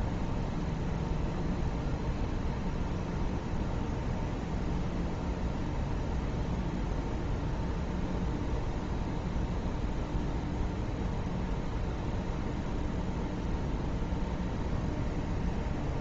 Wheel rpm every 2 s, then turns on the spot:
0, 0, 0, 0, 0, 0, 0, 0.
none